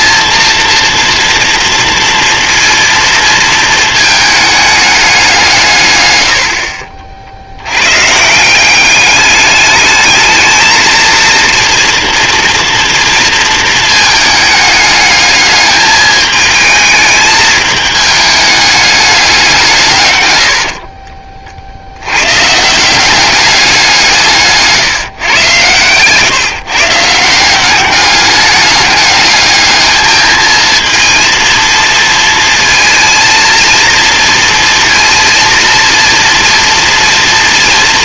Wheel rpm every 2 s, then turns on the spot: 230, 230, 210, 60, 200, 220, 230, 210, 220, 200, 50, 180, 150, 150, 210, 230, 230, 230, 240.
6-8 20-22